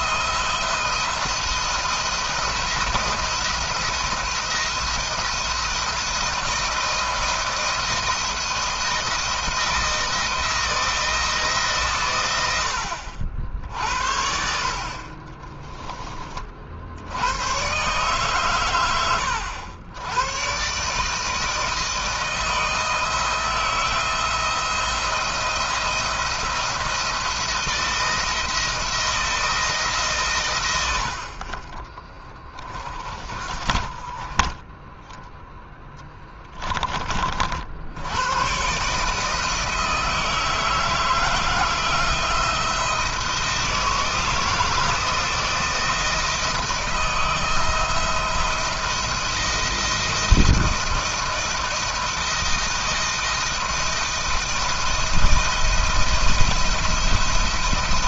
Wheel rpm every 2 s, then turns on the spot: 170, 170, 170, 160, 170, 160, 80, 50, 70, 100, 140, 170, 170, 170, 170, 80, 30, 10, 50, 140, 160, 170, 160, 160, 170, 160, 170, 170, 170.
32-34